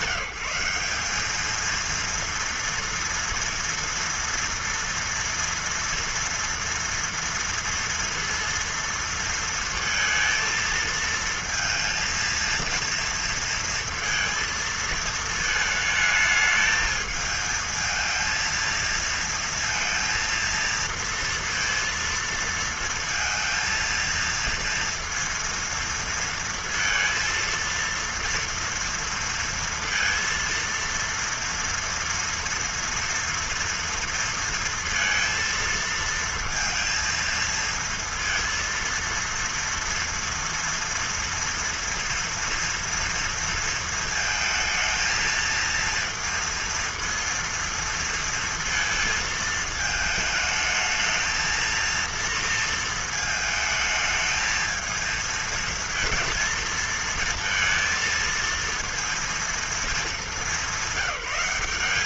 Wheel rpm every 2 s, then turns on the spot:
180, 230, 240, 230, 230, 230, 230, 230, 220, 230, 230, 230, 230, 230, 230, 230, 230, 230, 230, 230, 230, 230, 220, 230, 230, 220, 230, 220, 230, 230, 190.
none